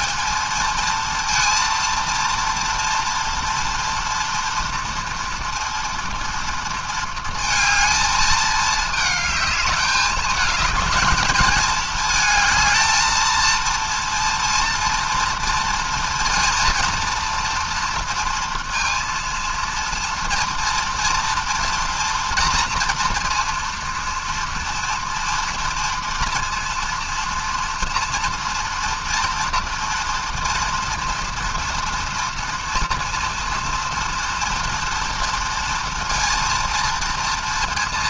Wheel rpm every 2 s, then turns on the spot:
220, 230, 230, 230, 220, 220, 220, 230, 230, 230, 230, 230, 230, 230, 230, 230, 230, 230, 230.
none